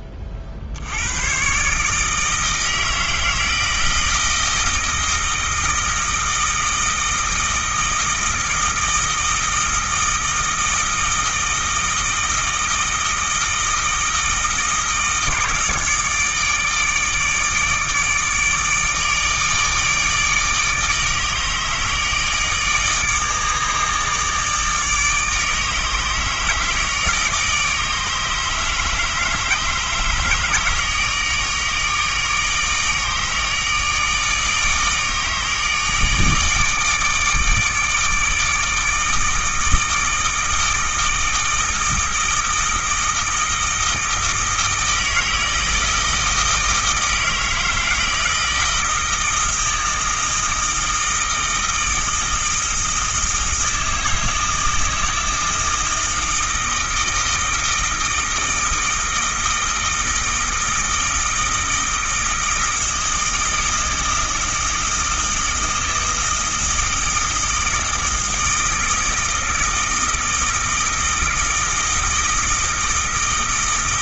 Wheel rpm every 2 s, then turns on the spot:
60, 160, 160, 160, 160, 160, 160, 160, 150, 150, 150, 150, 150, 150, 150, 150, 160, 150, 160, 160, 160, 160, 160, 160, 160, 160, 160, 160, 160, 160, 160, 160, 160, 160, 160, 160, 160.
none